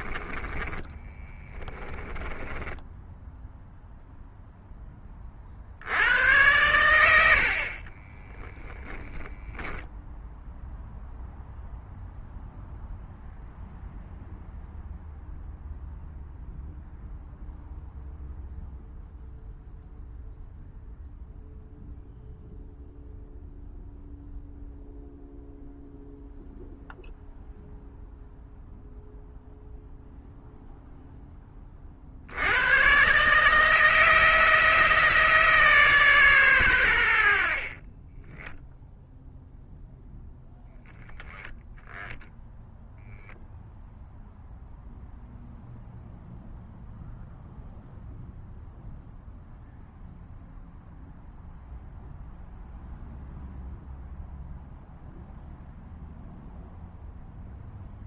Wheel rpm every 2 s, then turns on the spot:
10, 10, 10, 100, 10, 0, 0, 0, 0, 0, 0, 0, 0, 0, 0, 0, 110, 160, 110, 0, 10, 0, 0, 0, 0, 0, 0, 0, 0.
0-4